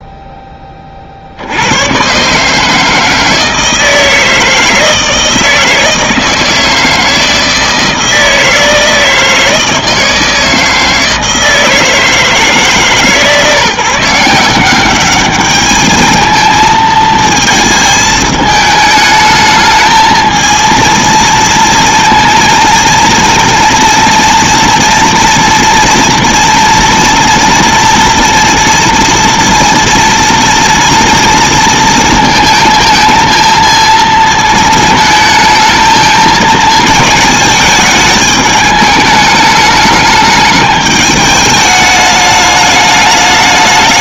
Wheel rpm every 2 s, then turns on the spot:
30, 150, 160, 160, 160, 160, 150, 180, 220, 220, 230, 230, 230, 230, 240, 230, 220, 220, 220, 210, 210, 210.
none